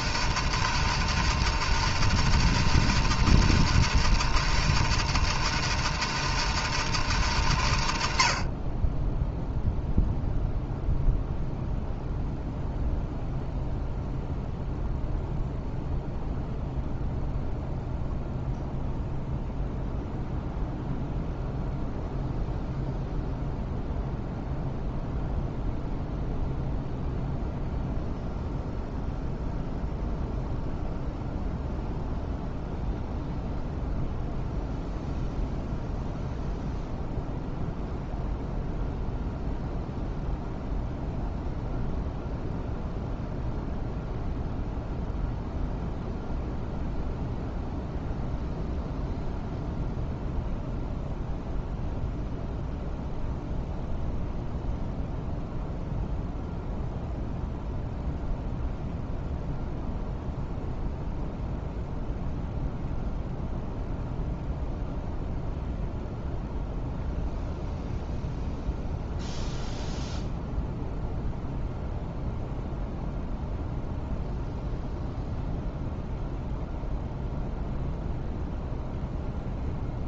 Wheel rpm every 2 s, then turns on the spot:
160, 160, 160, 160, 40, 0, 0, 0, 0, 0, 0, 0, 0, 0, 0, 0, 0, 0, 0, 0, 0, 0, 0, 0, 0, 0, 0, 0, 0, 0, 0, 0, 0, 0, 0, 0, 0, 0, 0, 0.
none